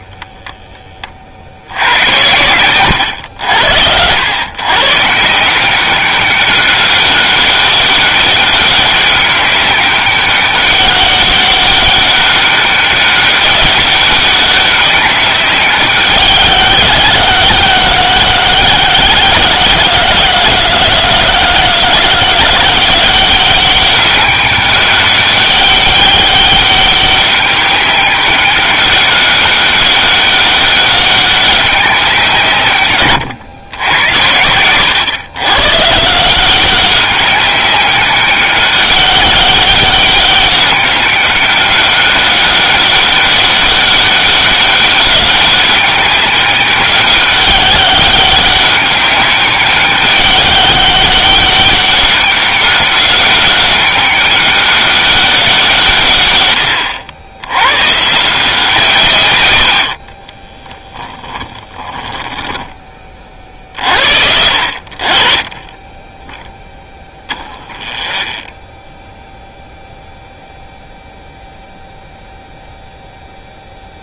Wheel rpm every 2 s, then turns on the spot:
0, 110, 110, 200, 200, 200, 200, 200, 190, 180, 170, 180, 200, 200, 200, 200, 150, 100, 180, 200, 200, 200, 190, 190, 200, 200, 200, 200, 110, 160, 20, 20, 60, 0, 0, 0, 0.
60-64